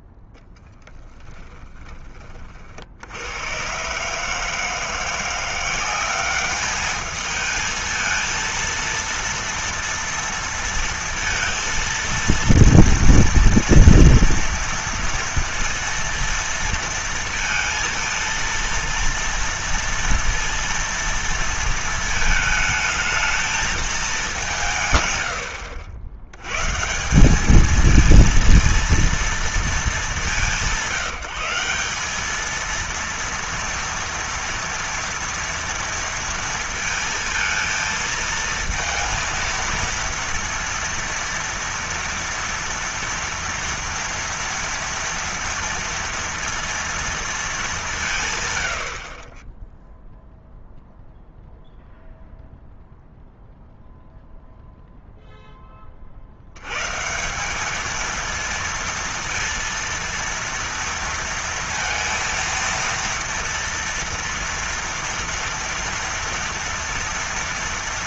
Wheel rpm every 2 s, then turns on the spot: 10, 40, 150, 200, 230, 230, 230, 240, 230, 230, 230, 220, 190, 120, 230, 190, 210, 230, 230, 220, 230, 230, 230, 230, 130, 0, 0, 0, 70, 230, 230, 230, 230, 230.
0-2